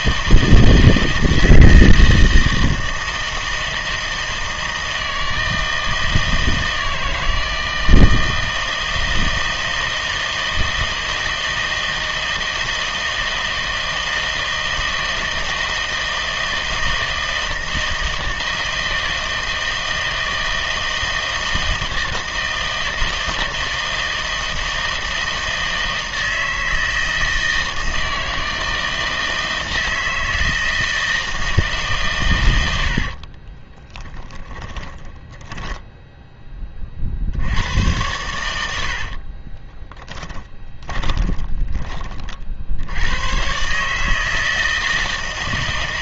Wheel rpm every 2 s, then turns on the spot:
160, 160, 160, 160, 160, 160, 160, 160, 160, 160, 160, 160, 160, 160, 160, 160, 80, 20, 30, 80, 20, 70, 160.
32-36 38-42